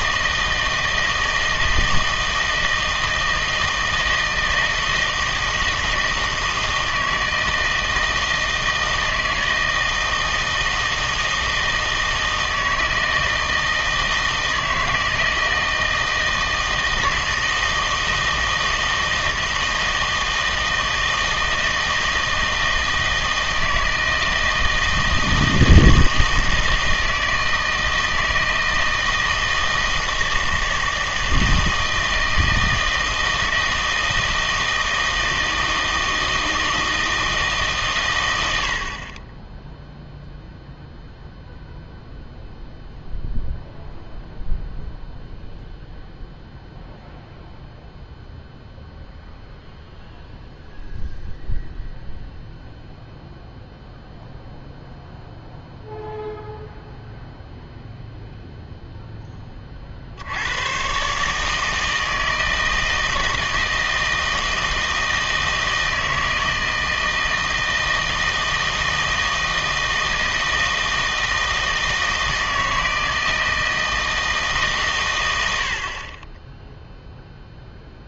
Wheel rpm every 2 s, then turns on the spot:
160, 160, 160, 160, 160, 160, 160, 160, 160, 160, 160, 160, 160, 160, 160, 160, 160, 160, 160, 60, 0, 0, 0, 0, 0, 0, 0, 0, 0, 0, 110, 160, 160, 160, 160, 160, 160, 140, 0.
none